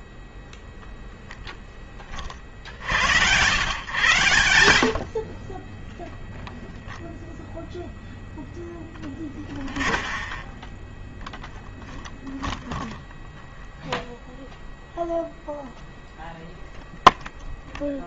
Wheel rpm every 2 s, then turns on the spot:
0, 60, 90, 20, 0, 0, 0, 0, 0.
none